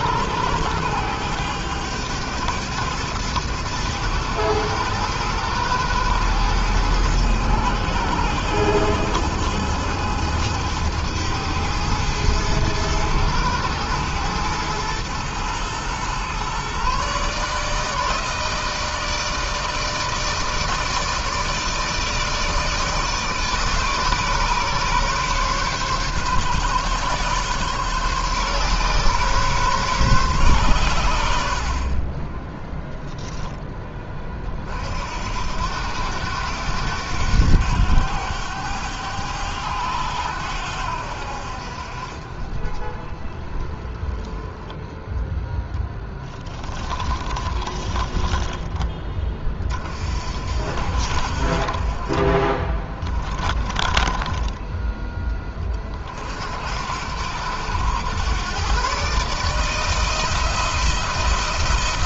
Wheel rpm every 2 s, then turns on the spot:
100, 110, 110, 110, 110, 110, 110, 110, 140, 160, 160, 150, 140, 130, 130, 110, 10, 50, 90, 100, 80, 20, 10, 20, 20, 60, 20, 10, 70, 130, 170.
46-48 52-54